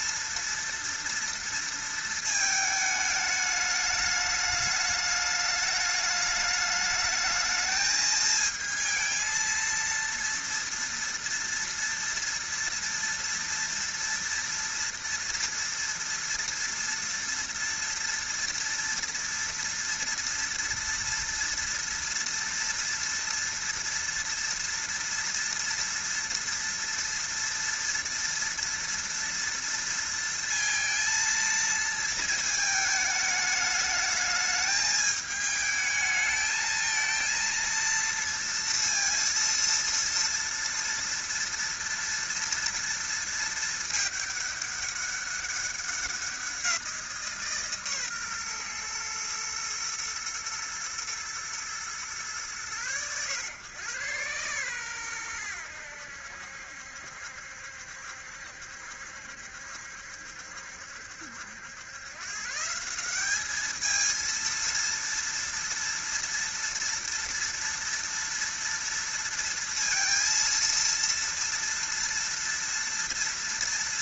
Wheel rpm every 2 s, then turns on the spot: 230, 210, 210, 220, 230, 230, 230, 230, 230, 230, 230, 230, 230, 230, 230, 230, 210, 220, 220, 230, 230, 230, 200, 170, 120, 110, 110, 120, 70, 70, 70, 180, 230, 230, 230, 230, 230.
none